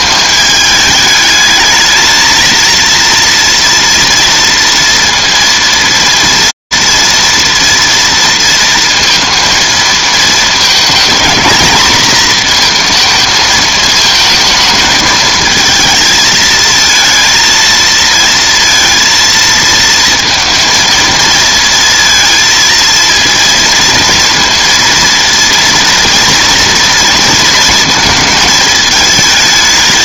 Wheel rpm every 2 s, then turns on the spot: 210, 230, 230, 230, 230, 220, 230, 220, 220, 230, 230, 230, 230, 230, 220.
none